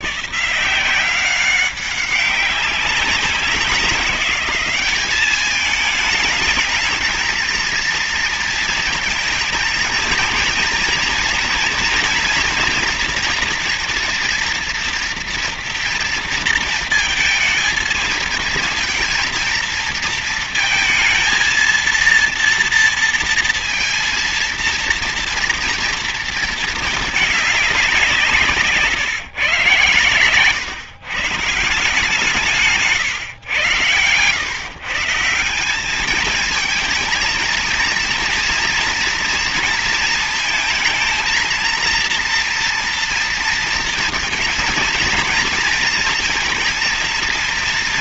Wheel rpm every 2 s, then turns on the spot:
160, 190, 200, 210, 220, 220, 230, 230, 230, 230, 220, 230, 230, 230, 160, 130, 160, 120, 220, 230, 220, 230, 220, 230.
none